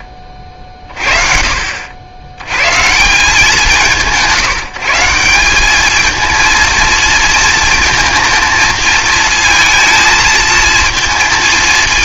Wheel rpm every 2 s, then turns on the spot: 50, 180, 180, 230, 230, 230.
none